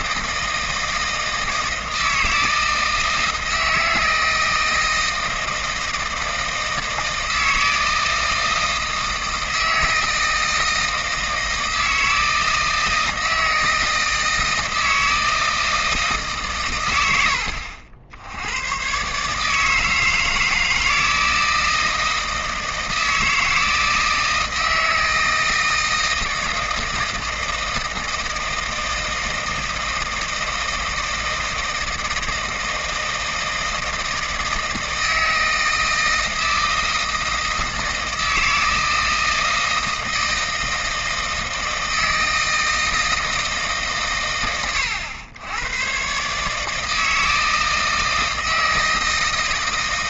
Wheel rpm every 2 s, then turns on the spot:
160, 160, 160, 160, 160, 160, 160, 160, 100, 120, 160, 160, 160, 160, 160, 160, 160, 160, 160, 160, 160, 160, 100, 150, 160.
none